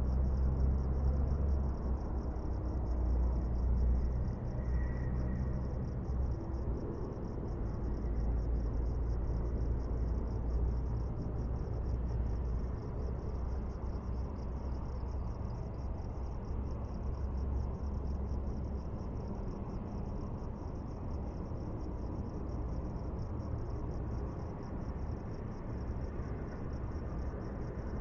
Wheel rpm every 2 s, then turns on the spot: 0, 0, 0, 0, 0, 0, 0, 0, 0, 0, 0, 0, 0, 0.
none